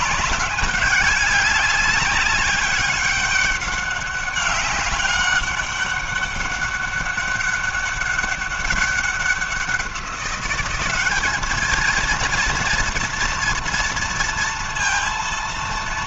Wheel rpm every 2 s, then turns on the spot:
200, 190, 200, 200, 190, 200, 230, 230.
none